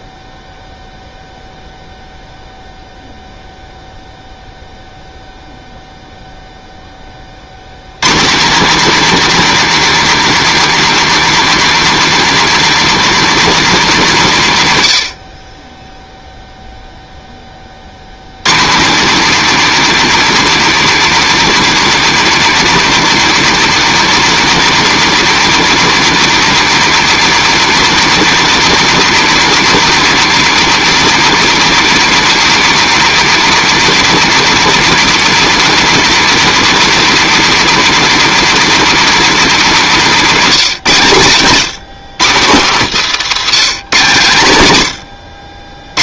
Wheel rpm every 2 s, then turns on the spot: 0, 0, 0, 0, 230, 290, 280, 170, 0, 150, 290, 280, 280, 290, 280, 280, 280, 280, 280, 290, 210, 160, 120.
none